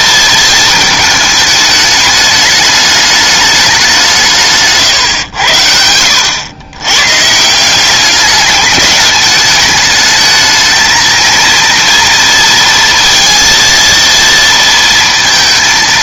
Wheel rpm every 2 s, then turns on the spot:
220, 210, 150, 110, 210, 220, 230, 230.
none